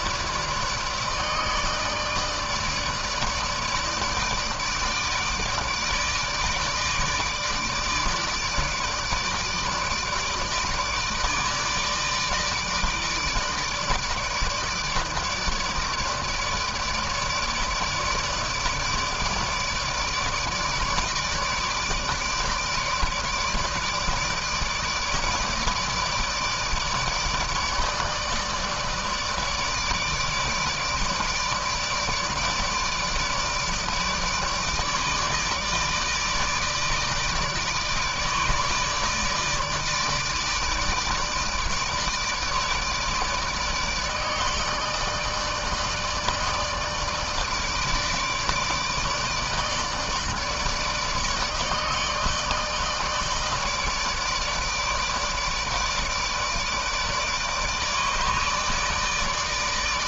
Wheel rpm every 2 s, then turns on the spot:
150, 150, 150, 150, 160, 160, 150, 150, 160, 160, 150, 160, 160, 160, 160, 160, 150, 150, 150, 150, 160, 150, 160, 160, 150, 160, 160, 160, 160, 160.
none